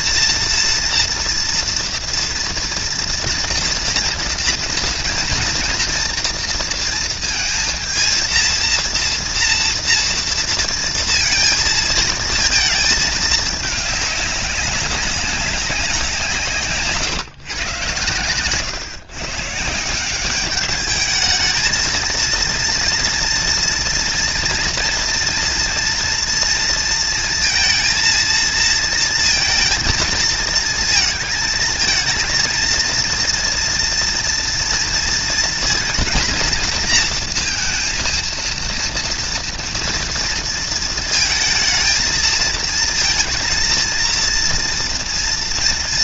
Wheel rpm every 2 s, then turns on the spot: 240, 230, 230, 230, 230, 230, 220, 200, 150, 130, 200, 230, 230, 230, 230, 220, 230, 230, 230, 230, 230, 220, 230.
none